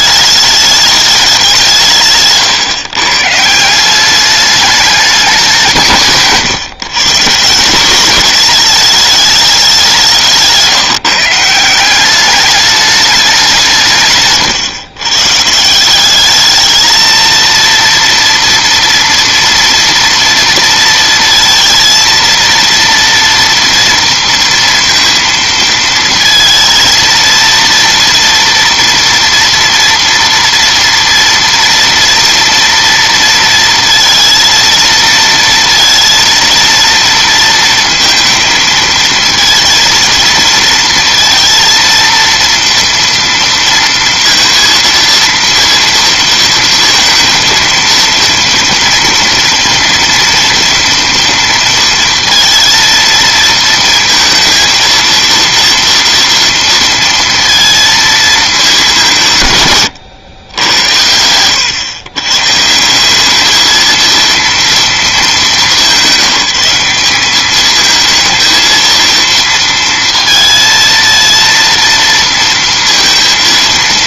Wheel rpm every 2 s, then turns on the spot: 210, 130, 210, 140, 210, 170, 210, 140, 220, 230, 230, 230, 230, 230, 230, 230, 230, 230, 230, 230, 230, 230, 230, 220, 230, 230, 230, 230, 230, 200, 90, 150, 220, 180, 220, 230, 230.
none